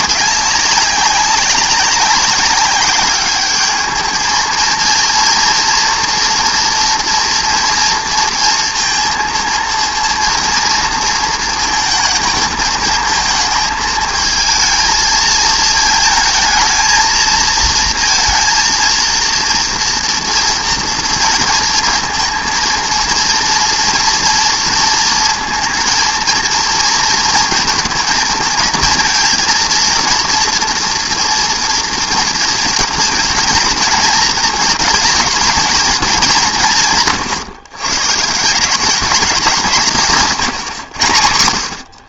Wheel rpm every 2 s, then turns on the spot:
200, 200, 220, 230, 230, 230, 220, 220, 220, 230, 230, 230, 230, 230, 230, 230, 220, 220, 170, 180, 140.
none